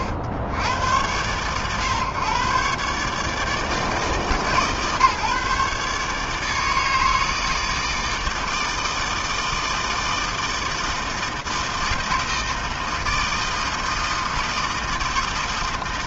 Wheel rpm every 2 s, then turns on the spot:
110, 130, 150, 150, 160, 160, 160, 160.
none